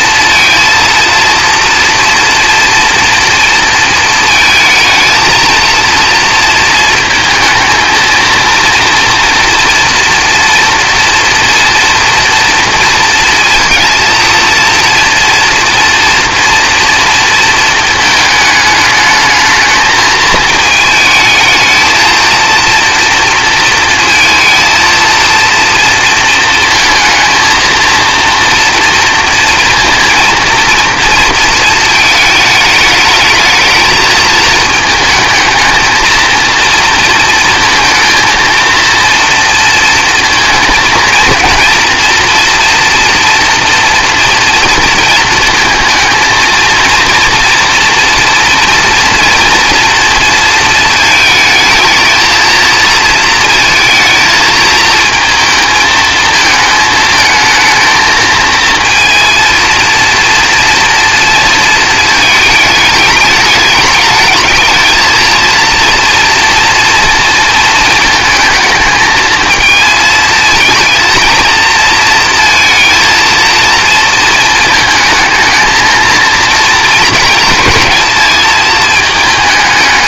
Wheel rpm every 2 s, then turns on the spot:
230, 240, 220, 230, 230, 240, 230, 230, 230, 220, 220, 230, 230, 230, 240, 230, 210, 220, 230, 230, 220, 240, 230, 230, 230, 220, 230, 220, 220, 230, 230, 220, 220, 230, 220, 230, 230, 220, 230, 220.
none